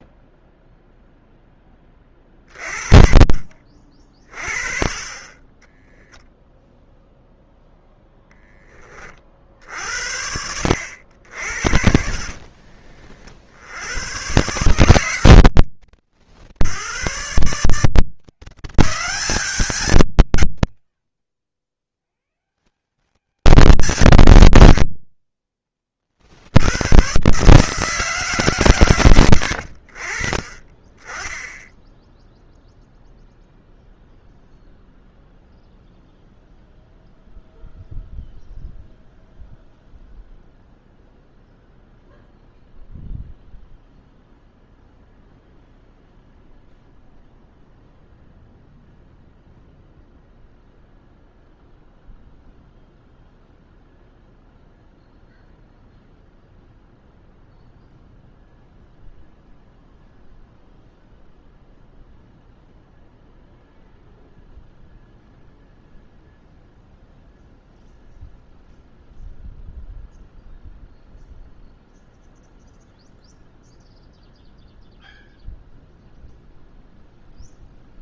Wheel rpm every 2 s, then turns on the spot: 0, 30, 30, 0, 20, 70, 50, 120, 80, 180, 130, 170, 100, 80, 140, 30, 0, 0, 0, 0, 0, 0, 0, 0, 0, 0, 0, 0, 0, 0, 0, 0, 0, 0, 0, 0, 0, 0, 0.
12-14